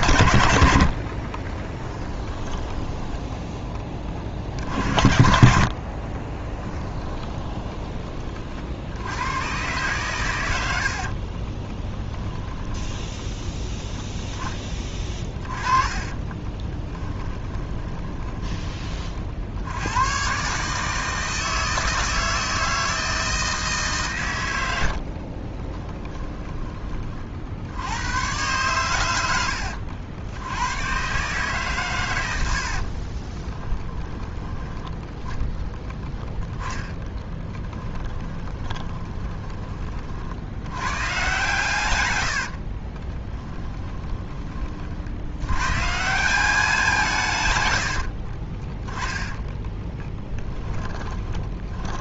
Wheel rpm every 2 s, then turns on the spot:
60, 10, 60, 10, 70, 70, 10, 20, 20, 30, 150, 160, 80, 30, 110, 110, 50, 10, 10, 20, 100, 40, 50, 190, 20, 10.
0-2 6-8 10-18 32-34 36-40 42-44 48-52